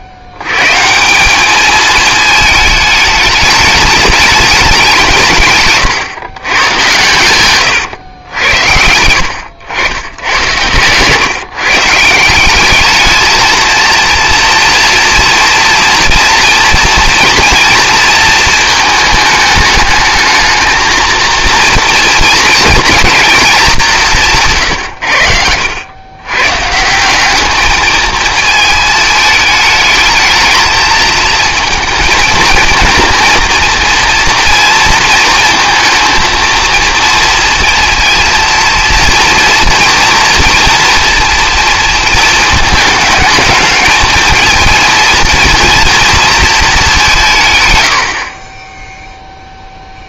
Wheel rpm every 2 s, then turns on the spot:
100, 220, 210, 120, 90, 100, 190, 240, 230, 220, 220, 230, 160, 130, 220, 220, 230, 230, 230, 230, 230, 220, 230, 230, 30.
none